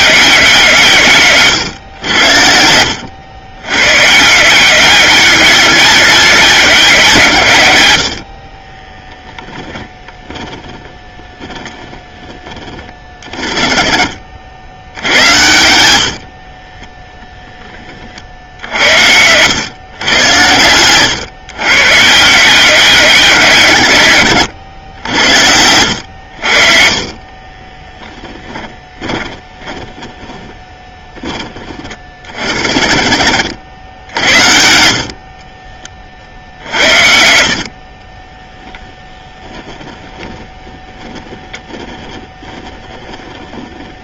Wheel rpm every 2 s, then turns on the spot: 160, 80, 180, 190, 30, 10, 20, 70, 30, 70, 110, 180, 100, 50, 10, 20, 60, 80, 70, 10, 10, 10.
2-4 8-10 16-18 20-22 26-32